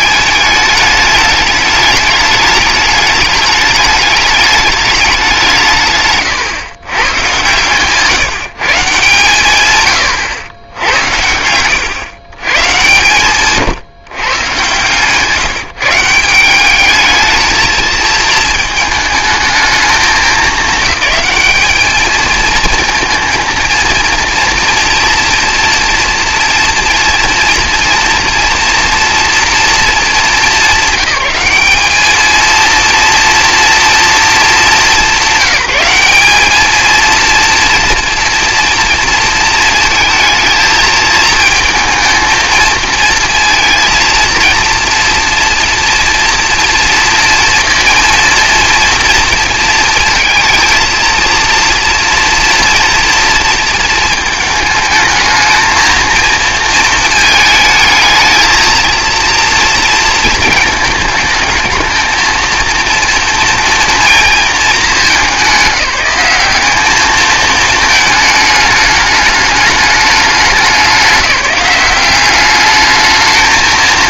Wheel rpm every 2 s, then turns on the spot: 210, 210, 210, 110, 150, 80, 120, 140, 190, 220, 220, 230, 230, 240, 230, 220, 220, 200, 220, 230, 220, 220, 230, 230, 230, 220, 230, 220, 220, 220, 220, 230, 230, 200, 210, 200, 210.
none